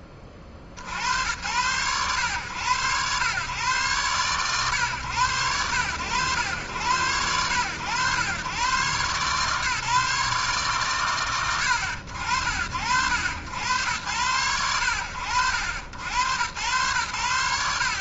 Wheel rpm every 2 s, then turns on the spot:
60, 100, 120, 90, 120, 110, 80, 80, 120.
none